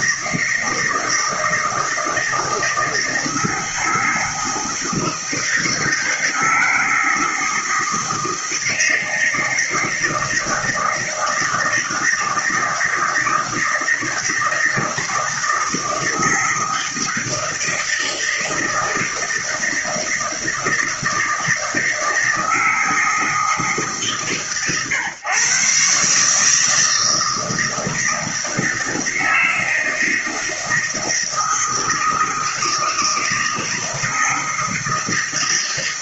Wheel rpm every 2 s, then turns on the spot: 160, 160, 160, 160, 160, 160, 160, 160, 160, 160, 160, 160, 130, 160, 160, 160, 160, 160.
none